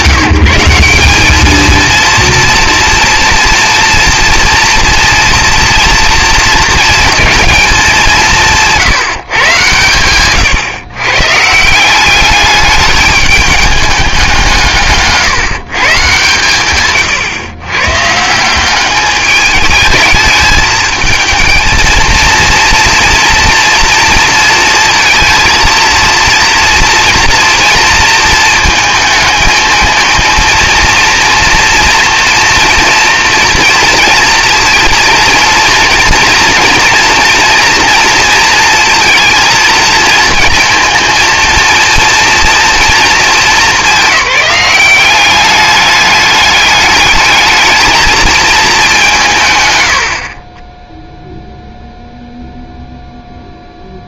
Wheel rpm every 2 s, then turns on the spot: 170, 230, 230, 230, 170, 120, 210, 170, 130, 180, 220, 230, 230, 230, 220, 230, 230, 230, 230, 230, 230, 230, 200, 200, 220, 20, 0.
none